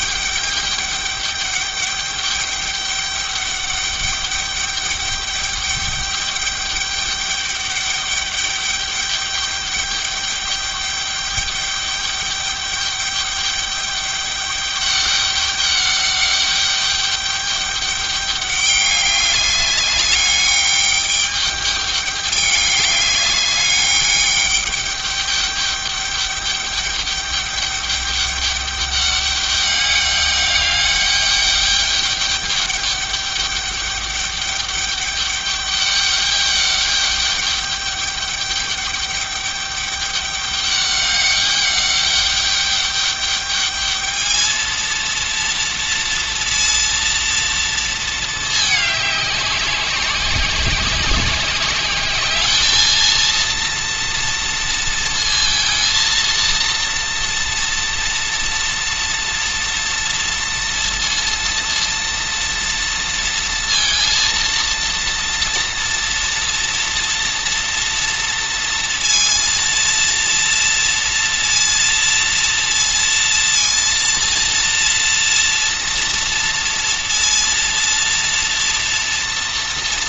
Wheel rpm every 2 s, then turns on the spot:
200, 200, 200, 200, 200, 210, 210, 200, 200, 200, 200, 200, 210, 210, 200, 200, 200, 200, 200, 200, 200, 200, 220, 230, 210, 190, 220, 230, 230, 240, 230, 230, 230, 230, 230, 230, 230, 230, 230, 230.
none